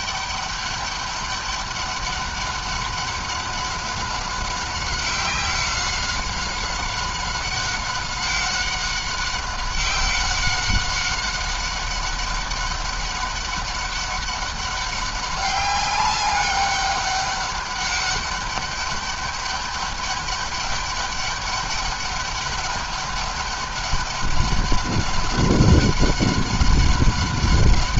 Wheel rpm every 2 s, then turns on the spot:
200, 200, 190, 200, 200, 190, 200, 200, 200, 200, 200, 200, 200, 190.
none